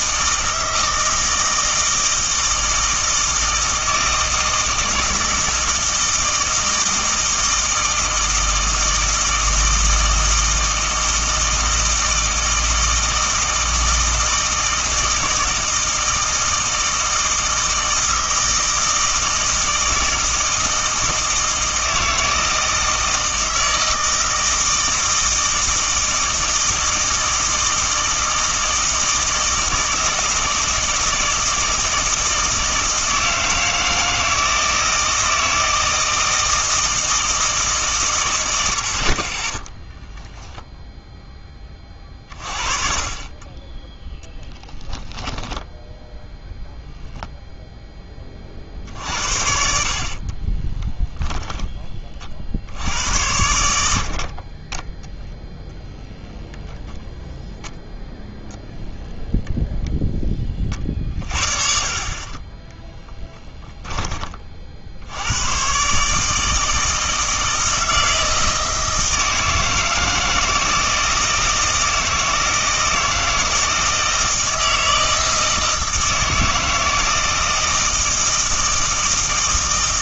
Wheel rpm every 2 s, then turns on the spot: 160, 160, 160, 160, 160, 160, 160, 160, 160, 160, 160, 160, 160, 160, 160, 160, 160, 160, 160, 100, 0, 30, 10, 0, 50, 20, 60, 20, 0, 0, 30, 20, 50, 160, 160, 160, 160, 160, 160, 160.
44-46 50-52